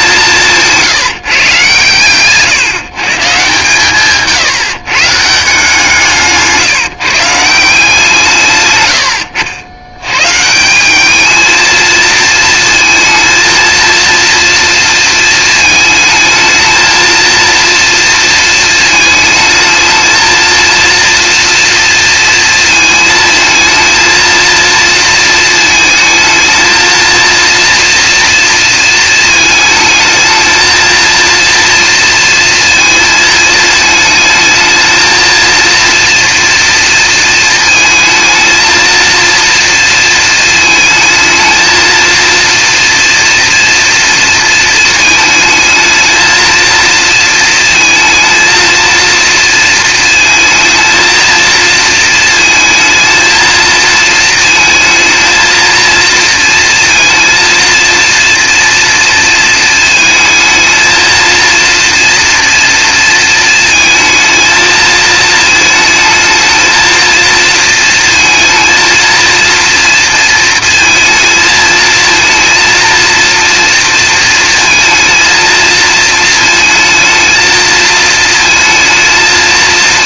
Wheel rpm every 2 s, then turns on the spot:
160, 150, 150, 160, 110, 180, 220, 230, 220, 220, 230, 220, 230, 220, 230, 230, 230, 220, 230, 230, 220, 230, 230, 230, 230, 230, 230, 230, 230, 230, 230, 230, 220, 220, 230, 230, 230, 230, 220, 230.
none